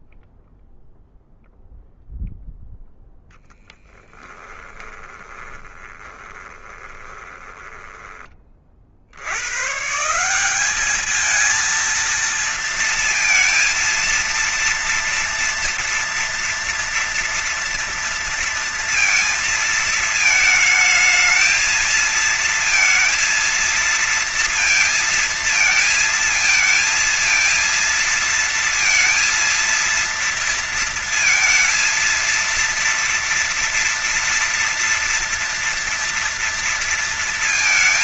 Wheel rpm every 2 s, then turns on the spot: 0, 0, 20, 20, 30, 180, 230, 230, 240, 230, 220, 230, 230, 230, 230, 230, 230, 230, 230.
4-8